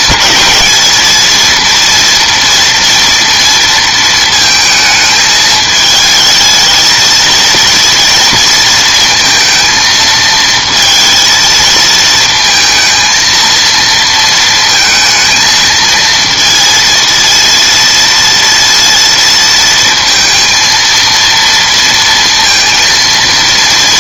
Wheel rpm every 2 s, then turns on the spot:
220, 230, 220, 220, 220, 230, 230, 230, 230, 230, 230, 230.
none